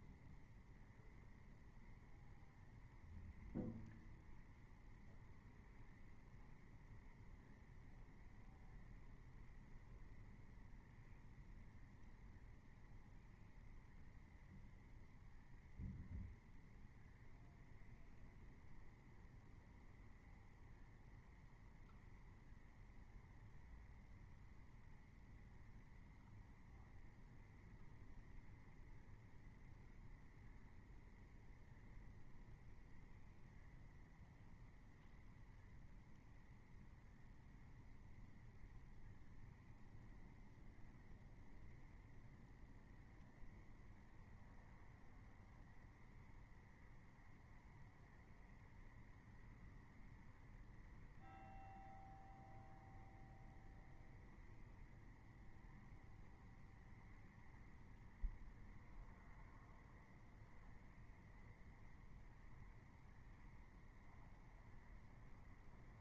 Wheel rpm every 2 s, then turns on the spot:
0, 0, 0, 0, 0, 0, 0, 0, 0, 0, 0, 0, 0, 0, 0, 0, 0, 0, 0, 0, 0, 0, 0, 0, 0, 0, 0, 0, 0, 0, 0, 0, 0.
none